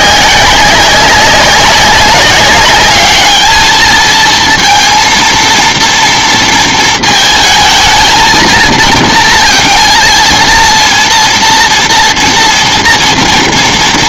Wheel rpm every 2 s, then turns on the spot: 190, 200, 230, 230, 230, 230, 230.
none